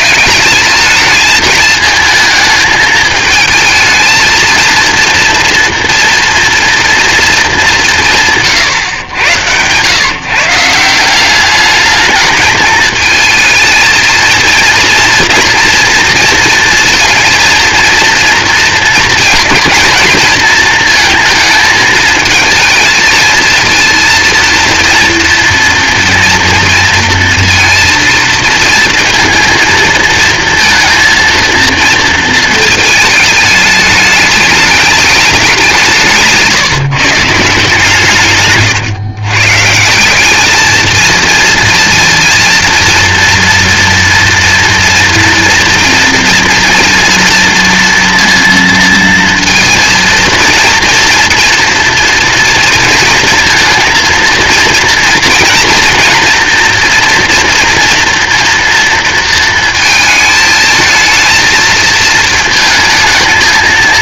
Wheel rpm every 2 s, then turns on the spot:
220, 220, 230, 230, 150, 180, 220, 230, 230, 230, 230, 230, 230, 230, 230, 230, 220, 210, 150, 130, 220, 230, 240, 230, 230, 230, 230, 230, 230, 230, 220, 220.
none